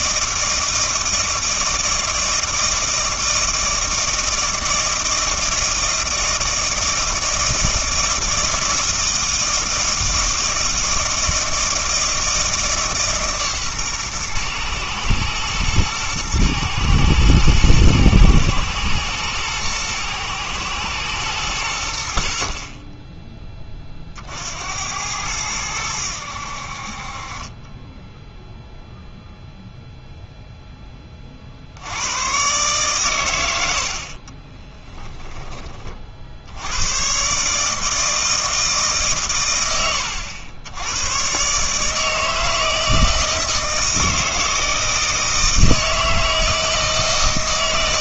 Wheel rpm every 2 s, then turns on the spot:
160, 160, 160, 160, 160, 160, 150, 120, 110, 120, 110, 40, 80, 60, 0, 10, 120, 20, 100, 150, 100, 160, 160, 160.
34-36